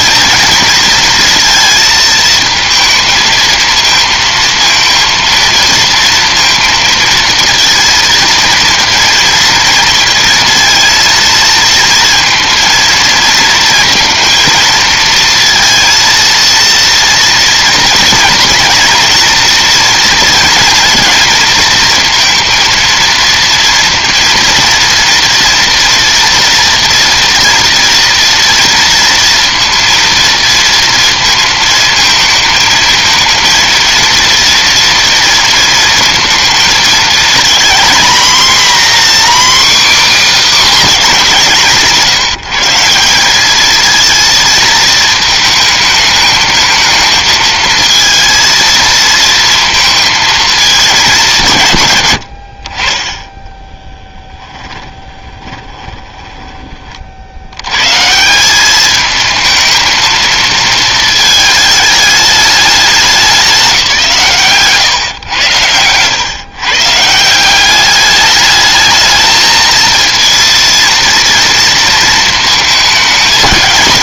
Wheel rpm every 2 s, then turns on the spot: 230, 220, 230, 230, 230, 230, 230, 230, 230, 240, 230, 230, 230, 230, 230, 230, 220, 230, 220, 240, 270, 170, 220, 220, 230, 230, 80, 20, 20, 180, 230, 200, 140, 130, 210, 230, 230.
54-58